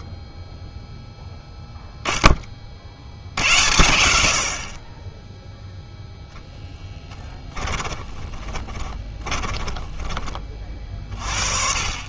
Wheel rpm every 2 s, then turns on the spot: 10, 40, 50, 10, 20, 30.
8-10